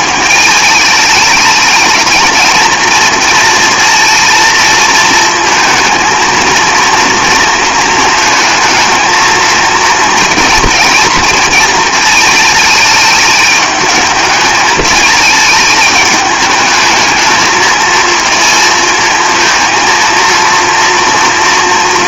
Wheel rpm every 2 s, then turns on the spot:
210, 220, 230, 230, 220, 230, 220, 220, 210, 230, 230.
none